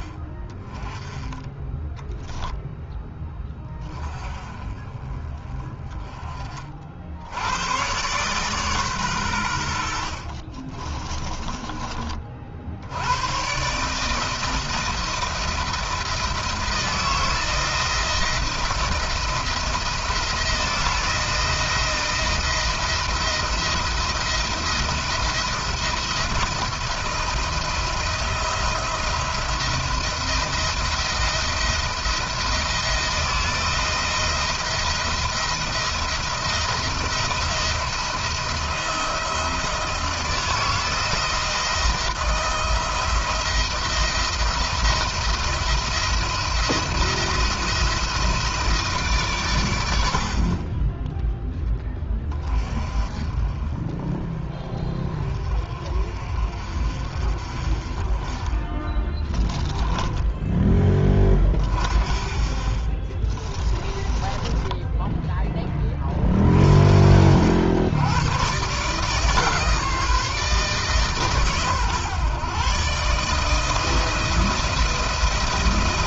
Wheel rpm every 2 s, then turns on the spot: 20, 10, 30, 50, 130, 30, 70, 160, 160, 170, 160, 170, 170, 160, 170, 170, 170, 170, 170, 170, 170, 170, 170, 170, 160, 20, 30, 20, 50, 20, 20, 30, 10, 50, 140, 160, 140, 170.
10-12 58-60 62-66